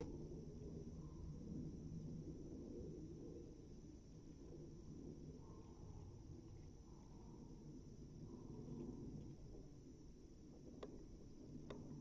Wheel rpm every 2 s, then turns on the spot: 0, 0, 0, 0, 0, 0.
none